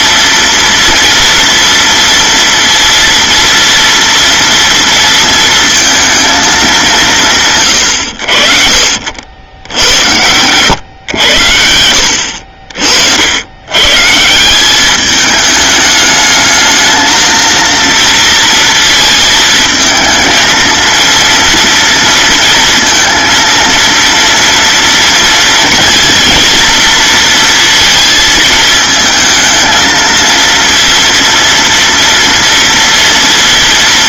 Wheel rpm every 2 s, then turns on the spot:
230, 230, 230, 200, 50, 110, 60, 200, 220, 230, 230, 230, 230, 230, 220, 230, 230.
none